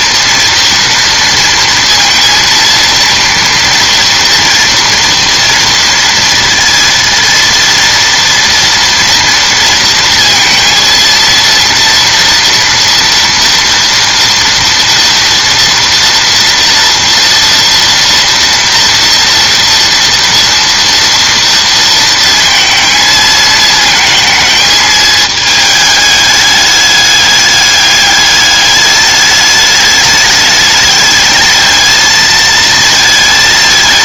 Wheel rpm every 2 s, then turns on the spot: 230, 230, 230, 230, 230, 230, 230, 230, 230, 230, 230, 230, 220, 210, 210, 210, 220.
none